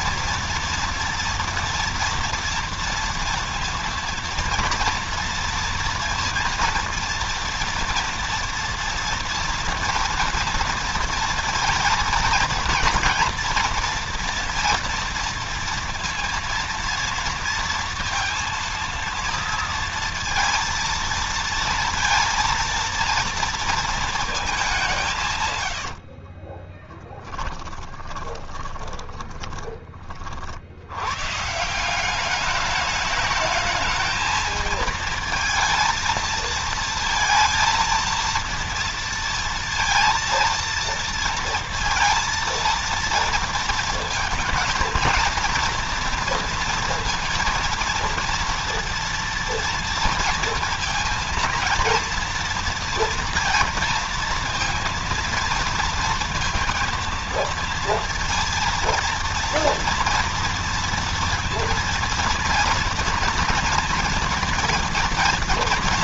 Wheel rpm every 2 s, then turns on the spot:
240, 230, 230, 230, 230, 230, 230, 230, 230, 230, 230, 230, 200, 30, 20, 70, 210, 220, 230, 230, 230, 230, 230, 230, 230, 230, 230, 230, 230, 230, 230, 230, 230.
26-30